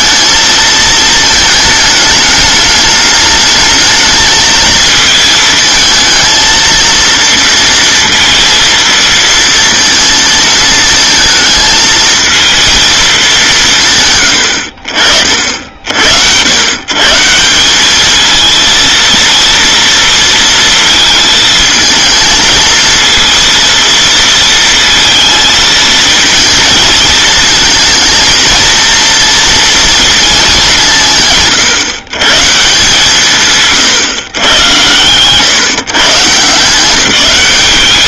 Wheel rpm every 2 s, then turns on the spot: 220, 210, 220, 230, 230, 230, 220, 60, 110, 230, 230, 220, 230, 220, 230, 190, 150, 110, 170.
none